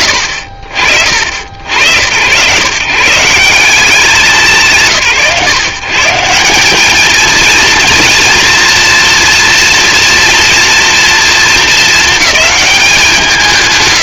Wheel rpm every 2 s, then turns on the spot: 60, 150, 140, 190, 240, 230, 180.
none